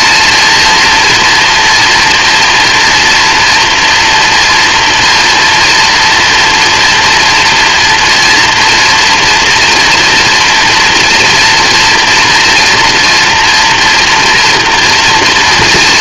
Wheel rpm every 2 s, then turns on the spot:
230, 230, 230, 240, 230, 230, 230, 230.
none